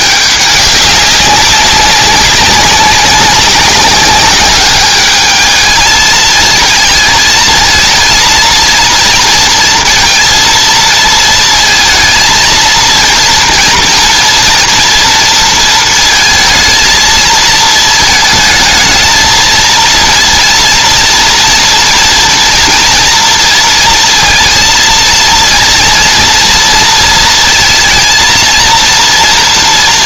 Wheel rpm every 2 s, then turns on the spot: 200, 190, 200, 220, 230, 230, 230, 230, 220, 220, 230, 230, 230, 230, 230.
none